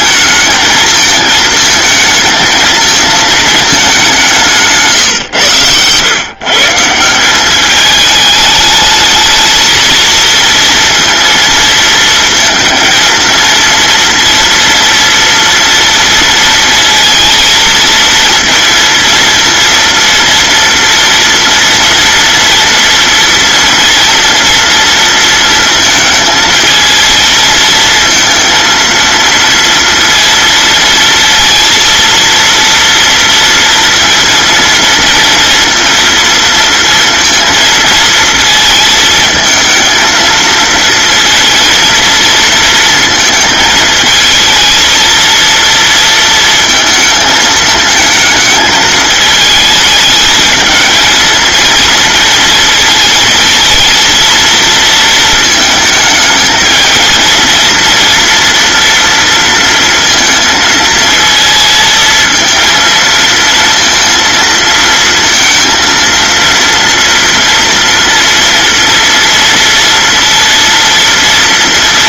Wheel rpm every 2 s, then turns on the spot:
220, 220, 140, 150, 220, 230, 230, 230, 230, 230, 230, 230, 230, 220, 230, 230, 230, 230, 230, 220, 230, 230, 220, 220, 220, 220, 230, 220, 220, 230, 230, 230, 230, 230, 230, 230.
none